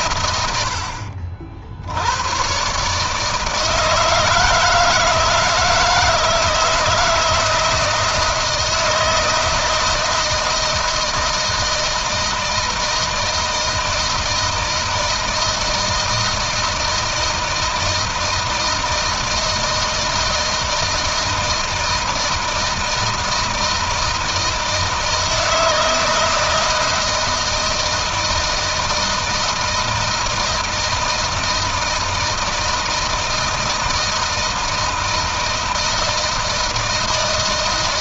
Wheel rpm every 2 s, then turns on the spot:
60, 140, 160, 160, 160, 160, 160, 160, 160, 160, 160, 160, 160, 160, 160, 160, 160, 160, 160.
none